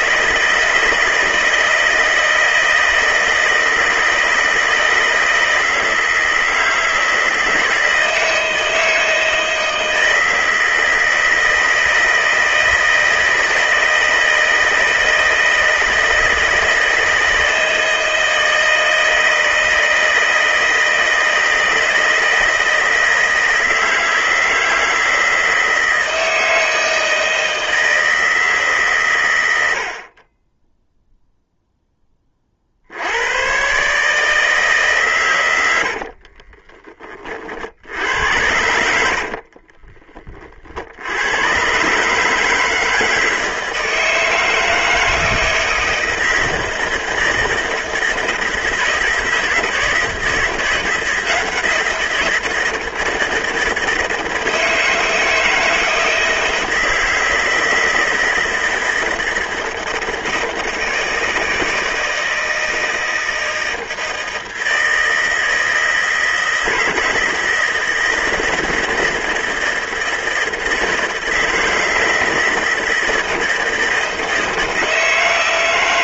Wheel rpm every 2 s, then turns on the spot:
160, 160, 160, 160, 160, 160, 160, 160, 160, 160, 160, 160, 160, 160, 130, 0, 90, 140, 30, 60, 70, 160, 160, 160, 160, 170, 160, 160, 160, 160, 160, 160, 160, 160, 160, 160, 160, 160.
38-40